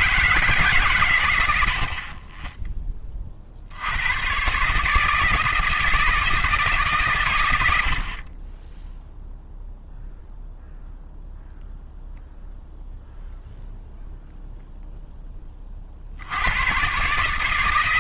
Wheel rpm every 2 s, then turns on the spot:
150, 20, 130, 160, 20, 0, 0, 0, 90.
none